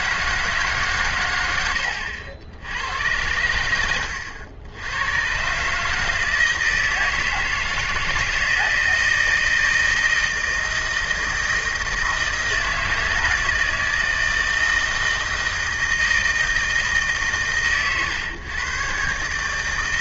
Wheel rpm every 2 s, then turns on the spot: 160, 70, 90, 160, 170, 160, 160, 160, 160, 120.
none